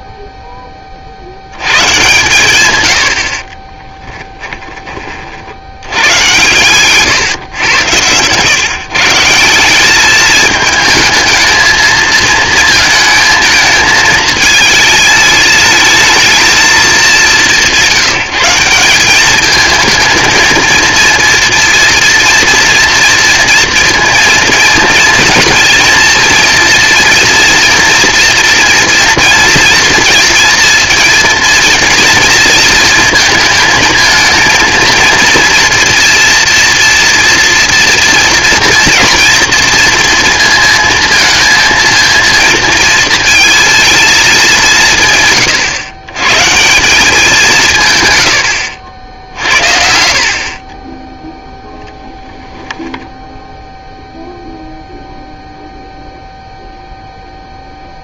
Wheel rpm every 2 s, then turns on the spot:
40, 100, 20, 130, 150, 220, 220, 220, 220, 180, 230, 230, 230, 230, 230, 230, 220, 230, 230, 230, 230, 230, 160, 170, 70, 30, 10, 0, 0.
none